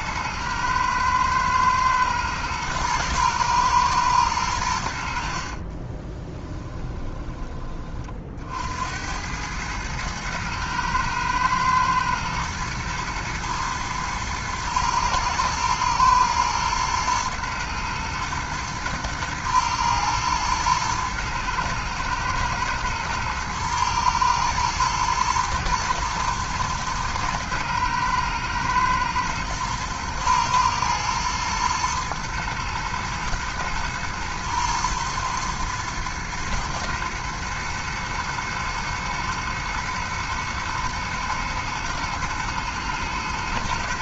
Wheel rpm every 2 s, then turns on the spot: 110, 110, 80, 20, 80, 110, 120, 110, 120, 120, 110, 110, 110, 110, 110, 110, 120, 110, 120, 110, 110, 110.
6-8